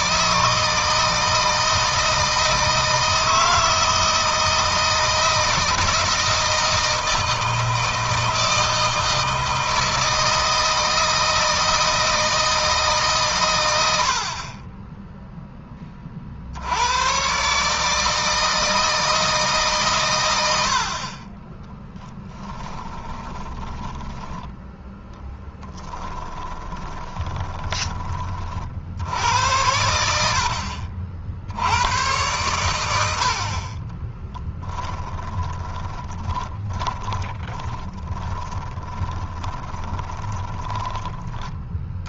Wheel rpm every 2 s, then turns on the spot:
160, 160, 160, 160, 160, 160, 150, 20, 90, 160, 50, 20, 10, 20, 60, 50, 80, 20, 30, 20, 10.
22-24 26-28 34-40